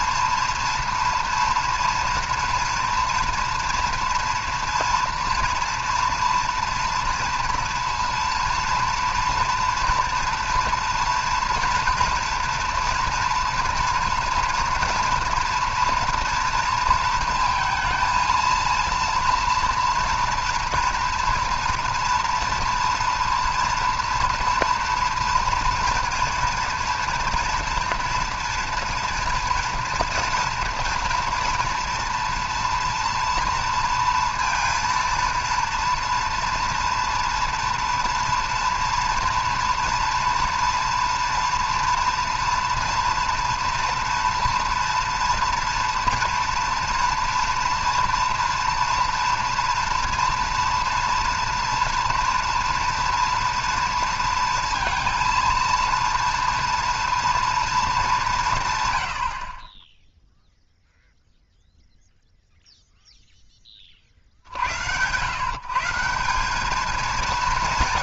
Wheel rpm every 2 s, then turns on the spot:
230, 230, 230, 230, 230, 230, 230, 230, 230, 230, 230, 230, 230, 230, 230, 230, 240, 230, 230, 230, 240, 240, 230, 230, 230, 230, 230, 230, 230, 150, 0, 0, 80, 210.
none